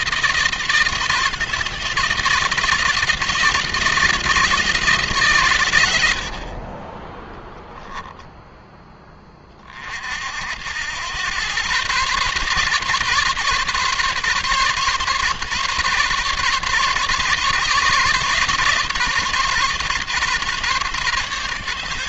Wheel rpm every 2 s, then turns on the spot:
160, 160, 160, 50, 20, 90, 140, 150, 140, 140, 140.
none